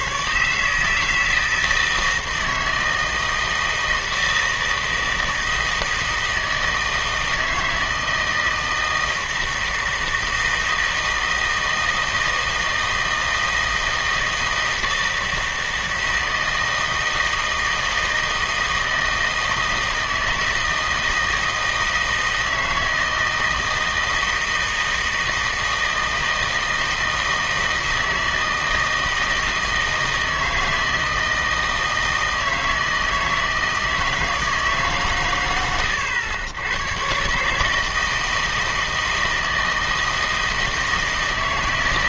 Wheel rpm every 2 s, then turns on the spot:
150, 160, 160, 160, 160, 160, 160, 160, 160, 160, 160, 160, 160, 160, 160, 160, 160, 150, 100, 160, 160.
none